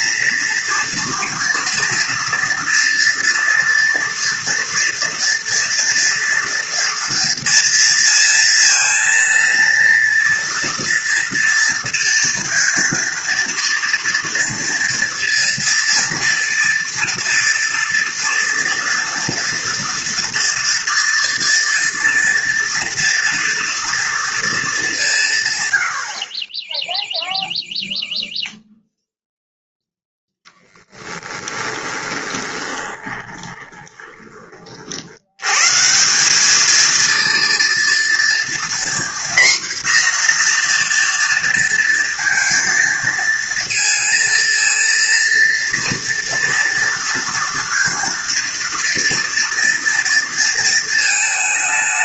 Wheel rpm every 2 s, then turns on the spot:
230, 230, 230, 230, 230, 230, 230, 230, 230, 230, 230, 230, 210, 10, 0, 0, 20, 40, 210, 240, 240, 230, 230, 230, 230, 230.
32-34